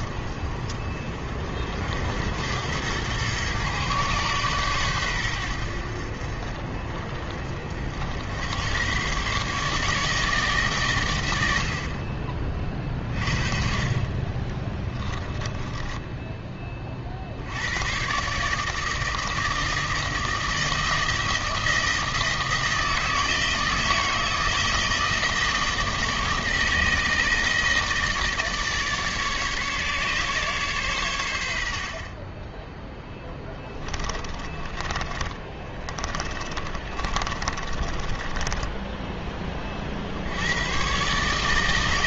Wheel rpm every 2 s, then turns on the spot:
50, 100, 120, 60, 110, 140, 30, 20, 20, 150, 160, 160, 160, 160, 150, 130, 10, 20, 30, 20, 110.
14-16 34-40